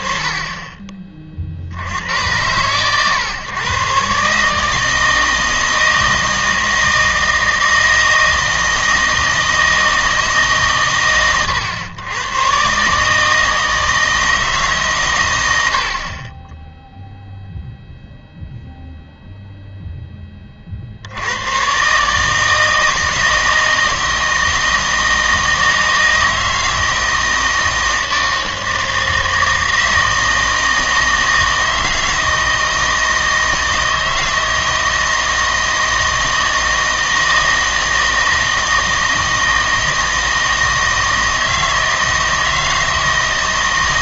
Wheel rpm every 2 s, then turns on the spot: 30, 110, 150, 160, 160, 140, 130, 150, 10, 0, 40, 160, 160, 160, 160, 160, 160, 160, 160, 160, 160, 160.
none